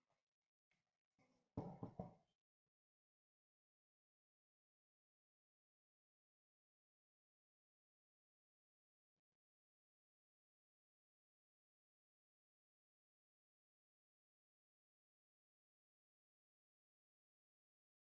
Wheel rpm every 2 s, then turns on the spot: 0, 0, 0, 0, 0, 0, 0, 0, 0.
none